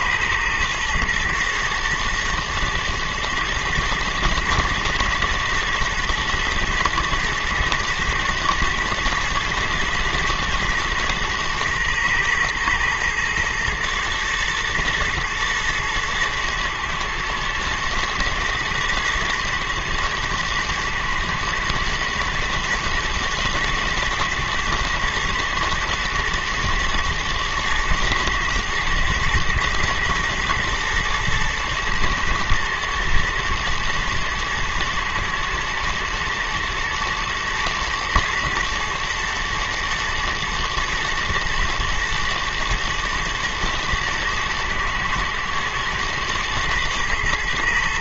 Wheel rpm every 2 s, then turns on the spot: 120, 110, 110, 110, 110, 110, 110, 120, 120, 120, 120, 120, 110, 110, 110, 110, 110, 120, 120, 110, 120, 120, 110, 110.
none